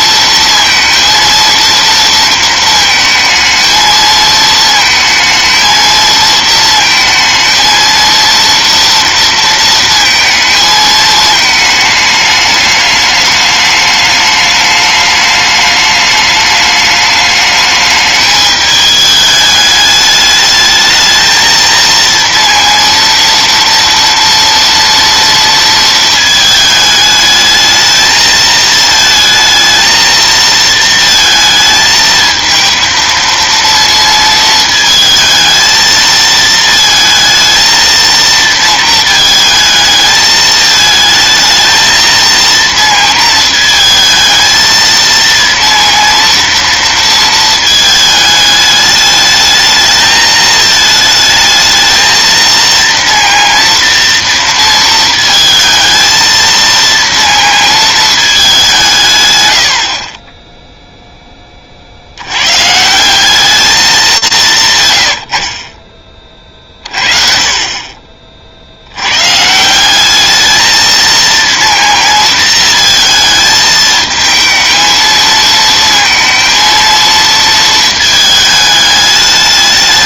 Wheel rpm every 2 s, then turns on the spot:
230, 220, 220, 230, 230, 220, 210, 210, 210, 210, 210, 230, 240, 220, 220, 230, 230, 220, 220, 230, 220, 230, 230, 230, 210, 220, 230, 230, 230, 190, 10, 120, 170, 40, 60, 220, 230, 220, 230, 220.
60-62